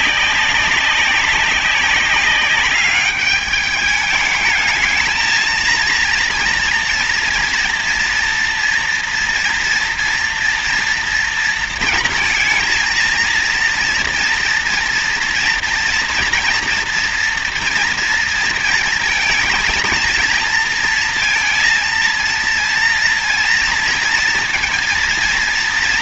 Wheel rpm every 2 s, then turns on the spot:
200, 200, 220, 230, 230, 230, 230, 230, 240, 230, 230, 230, 230.
none